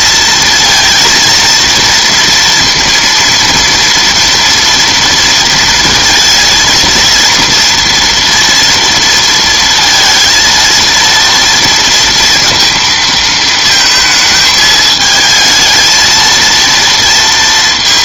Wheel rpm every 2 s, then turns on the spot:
230, 230, 230, 230, 230, 230, 230, 220, 230.
none